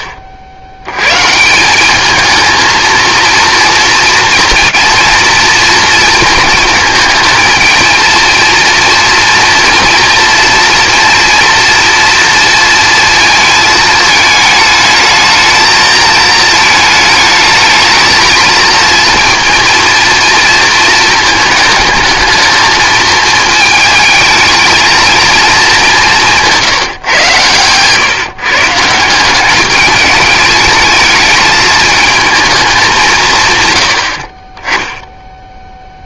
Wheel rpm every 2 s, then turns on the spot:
50, 190, 230, 230, 230, 230, 230, 220, 220, 220, 230, 220, 220, 200, 130, 210, 220, 90.
none